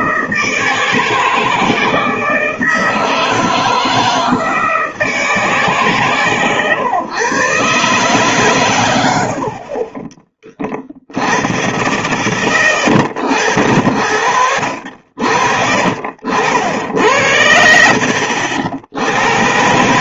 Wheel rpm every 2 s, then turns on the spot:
160, 160, 160, 130, 130, 30, 90, 80, 70, 70.
none